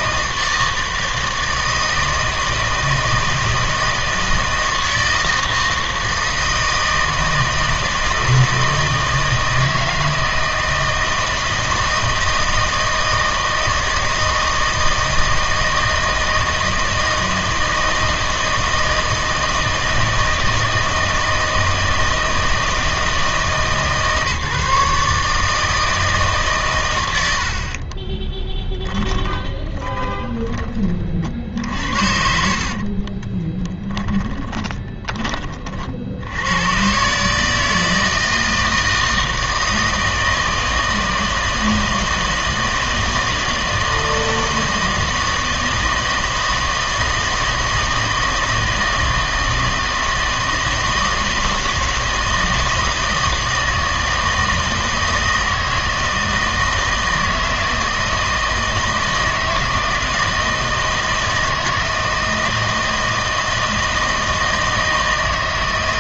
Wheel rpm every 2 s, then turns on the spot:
160, 160, 160, 160, 160, 160, 160, 160, 160, 160, 160, 160, 150, 130, 20, 30, 50, 20, 100, 160, 160, 160, 160, 160, 160, 160, 160, 160, 160, 160, 160, 160, 160.
28-30 32-36